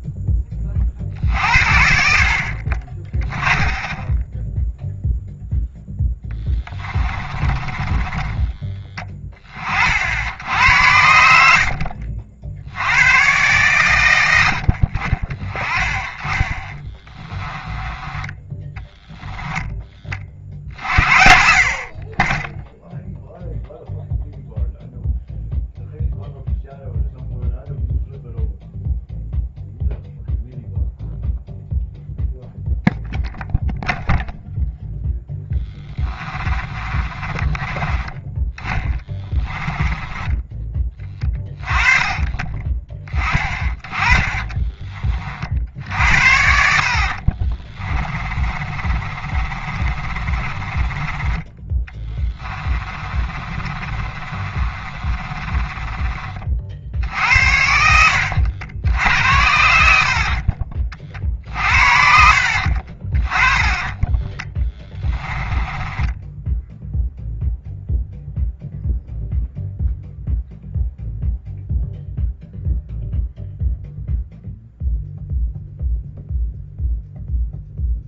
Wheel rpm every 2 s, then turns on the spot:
40, 40, 0, 20, 20, 80, 80, 50, 20, 10, 50, 10, 0, 0, 0, 0, 0, 0, 30, 10, 20, 20, 20, 60, 30, 20, 30, 30, 50, 80, 40, 50, 10, 0, 0, 0, 0, 0, 0.
6-10 16-18 36-40 44-56 62-66